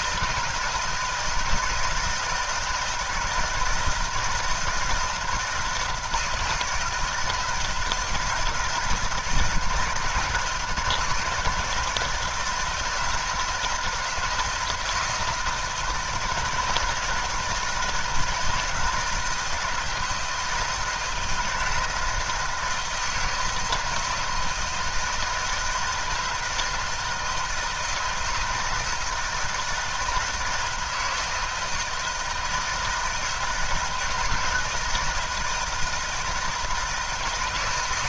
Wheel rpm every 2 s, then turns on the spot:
160, 160, 160, 160, 160, 160, 170, 160, 160, 160, 160, 160, 160, 160, 160, 160, 160, 160, 160.
none